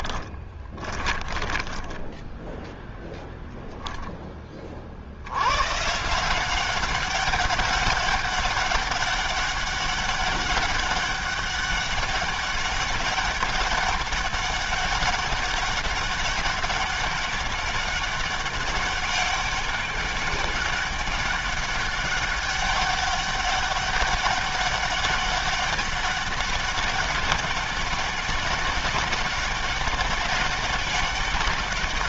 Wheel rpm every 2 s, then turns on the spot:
20, 0, 20, 170, 200, 200, 190, 200, 200, 200, 200, 200, 200, 200, 200, 190.
0-2